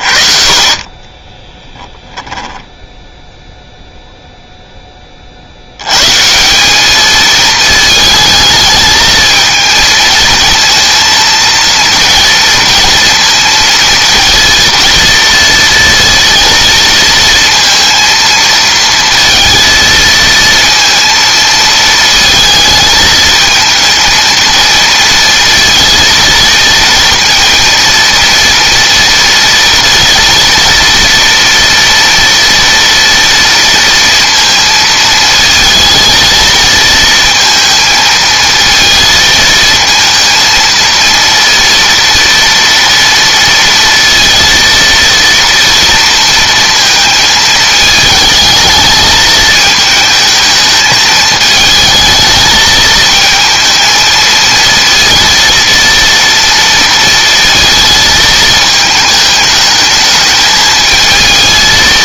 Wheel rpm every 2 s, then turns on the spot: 30, 10, 10, 200, 220, 230, 230, 230, 230, 230, 230, 220, 230, 230, 230, 230, 230, 220, 230, 220, 230, 230, 230, 220, 220, 220, 220, 230, 230, 220, 220.
2-4